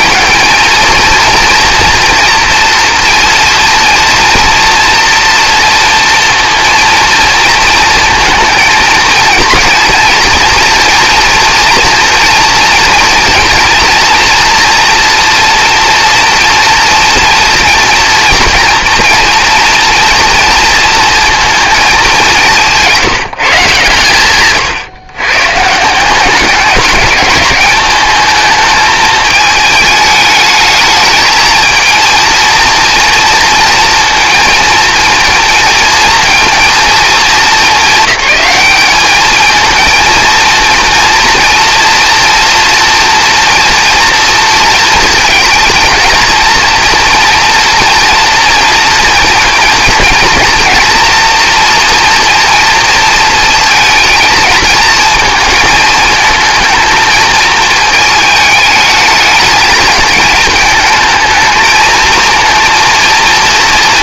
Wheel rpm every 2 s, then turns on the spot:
230, 230, 240, 230, 220, 230, 230, 230, 230, 230, 220, 170, 120, 210, 220, 220, 230, 230, 220, 210, 230, 230, 230, 230, 230, 240, 230, 220, 220, 220, 220, 230.
none